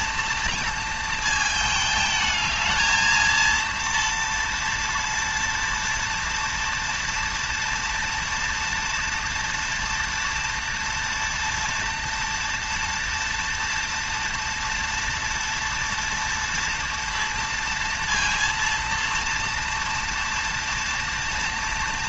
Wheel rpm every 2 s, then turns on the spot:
230, 220, 230, 240, 230, 240, 230, 230, 230, 230, 230.
none